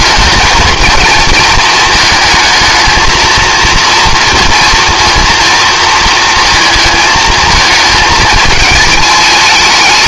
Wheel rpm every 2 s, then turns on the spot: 220, 220, 230, 220, 220.
none